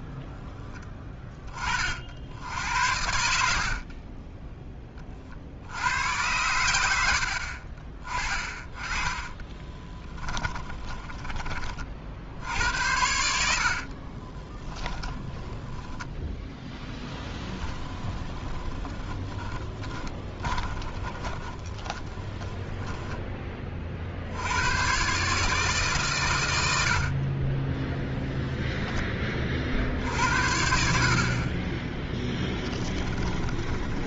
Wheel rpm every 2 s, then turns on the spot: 60, 10, 110, 30, 10, 40, 50, 10, 20, 20, 20, 30, 150, 20, 40, 20, 20.
6-10 12-22 26-28 32-34